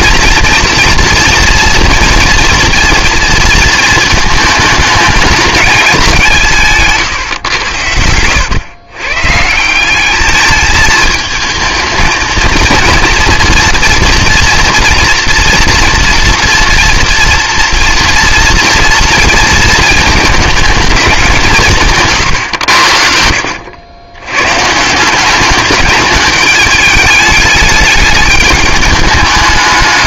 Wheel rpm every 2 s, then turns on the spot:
240, 230, 210, 170, 120, 220, 230, 230, 230, 230, 220, 80, 140, 210, 210.
none